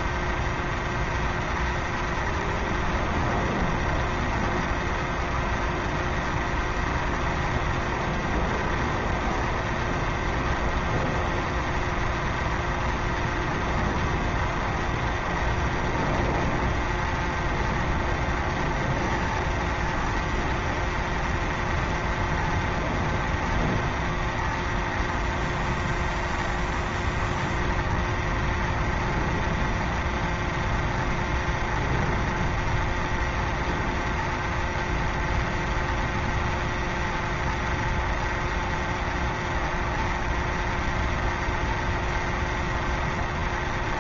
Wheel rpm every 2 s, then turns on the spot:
0, 0, 0, 0, 0, 0, 0, 0, 0, 0, 0, 0, 0, 0, 0, 0, 0, 0, 0, 0, 0, 0.
none